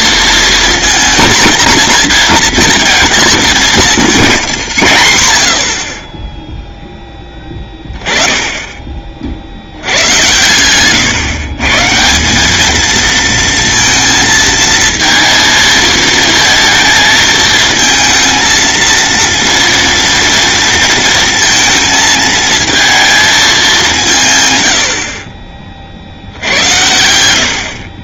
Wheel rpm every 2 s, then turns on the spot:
240, 230, 120, 10, 30, 130, 220, 230, 230, 230, 230, 220, 80, 90.
none